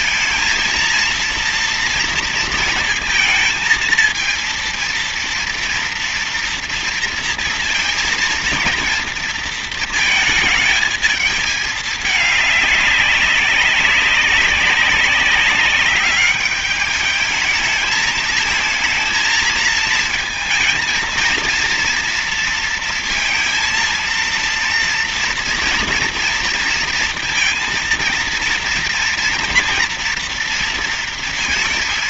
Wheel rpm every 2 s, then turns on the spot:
230, 230, 230, 230, 230, 220, 200, 190, 210, 220, 230, 230, 230, 230, 230, 230.
none